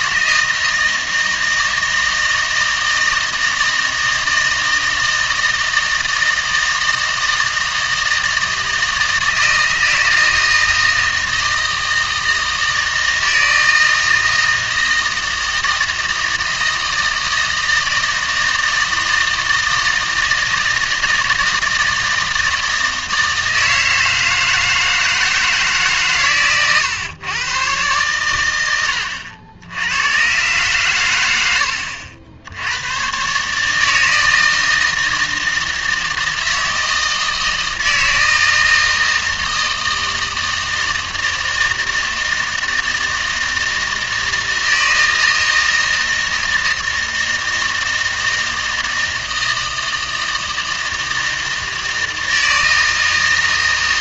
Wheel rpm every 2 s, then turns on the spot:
160, 160, 160, 160, 160, 160, 160, 160, 160, 160, 160, 160, 160, 120, 80, 120, 100, 160, 160, 160, 160, 160, 160, 160, 160, 160, 160.
none